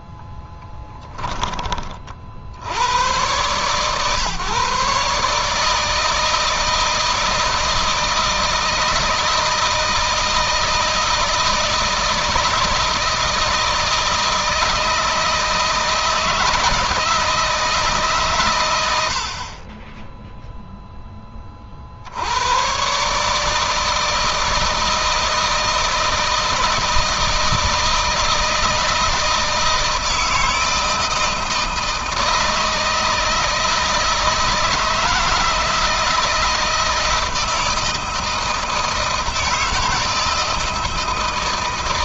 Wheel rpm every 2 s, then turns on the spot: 10, 90, 140, 160, 160, 160, 160, 160, 160, 100, 0, 120, 160, 160, 160, 160, 160, 160, 160, 160, 160.
0-2